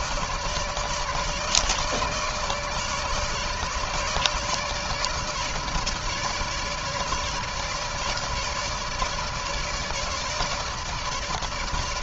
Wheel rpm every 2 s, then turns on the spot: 150, 150, 150, 150, 150, 160.
none